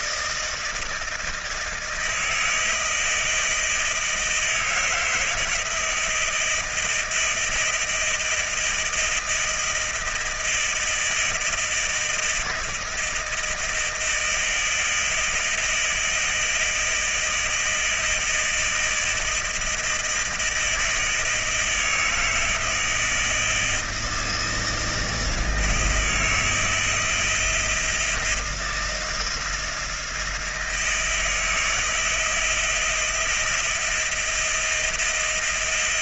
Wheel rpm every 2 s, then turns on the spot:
160, 160, 160, 160, 160, 160, 160, 160, 160, 160, 160, 160, 160, 160, 160, 170, 170, 170.
none